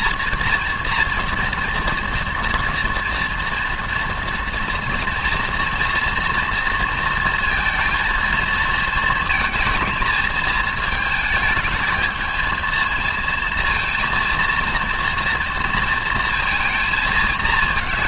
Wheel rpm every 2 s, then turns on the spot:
230, 230, 230, 230, 220, 220, 220, 230, 230.
none